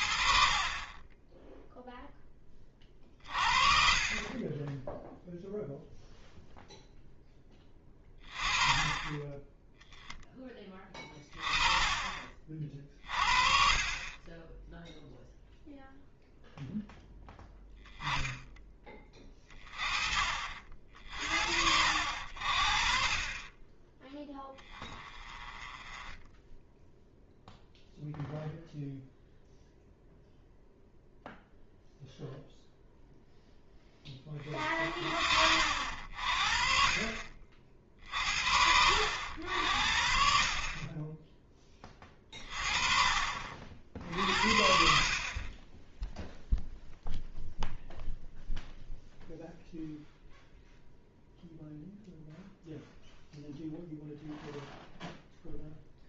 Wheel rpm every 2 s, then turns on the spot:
30, 30, 10, 0, 30, 20, 40, 0, 0, 20, 60, 40, 20, 0, 0, 0, 0, 40, 40, 70, 30, 30, 60, 0, 0, 0, 0, 0.
none